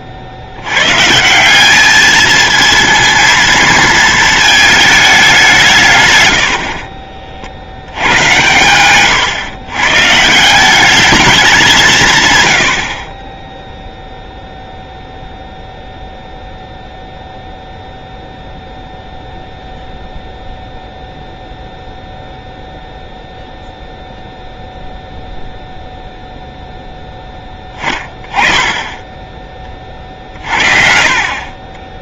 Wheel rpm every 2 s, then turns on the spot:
120, 230, 220, 50, 120, 200, 50, 0, 0, 0, 0, 0, 0, 0, 10, 40.
6-10